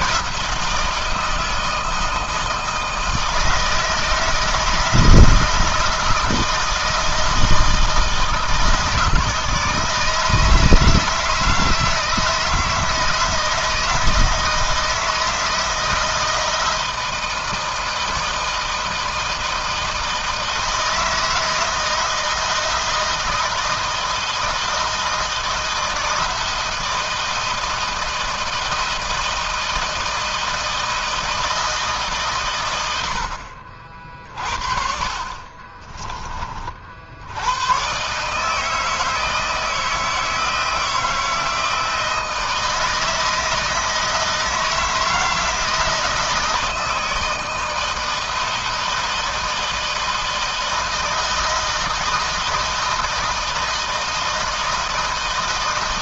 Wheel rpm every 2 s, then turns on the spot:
160, 160, 160, 160, 160, 160, 160, 160, 160, 160, 160, 160, 160, 160, 160, 160, 90, 40, 50, 160, 160, 160, 160, 160, 160, 160, 160, 160.
none